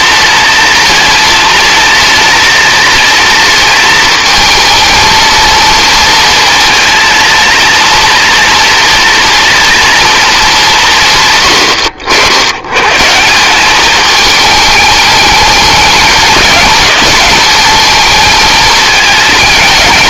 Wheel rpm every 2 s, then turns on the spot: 220, 230, 220, 230, 230, 180, 120, 210, 210, 220.
none